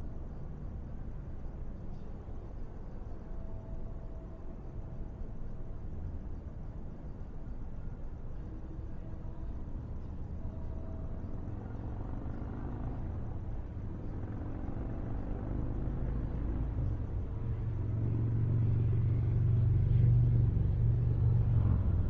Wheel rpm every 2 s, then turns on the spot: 0, 0, 0, 0, 0, 0, 0, 0, 0, 0, 0.
none